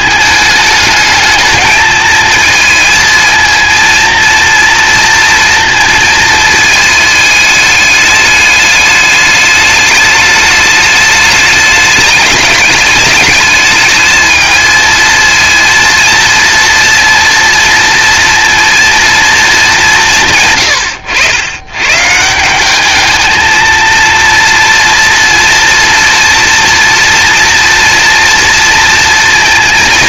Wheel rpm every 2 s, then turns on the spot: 210, 220, 230, 220, 210, 210, 210, 220, 230, 230, 100, 180, 230, 230, 230.
none